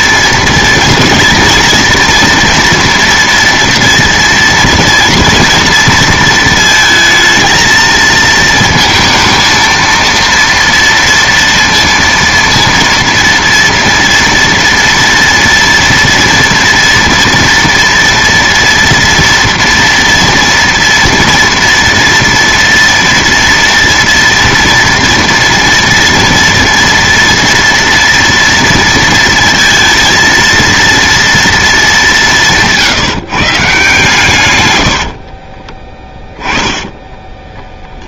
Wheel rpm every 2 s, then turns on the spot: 230, 230, 230, 220, 220, 230, 230, 230, 230, 230, 230, 230, 230, 230, 230, 230, 170, 120, 10.
36-38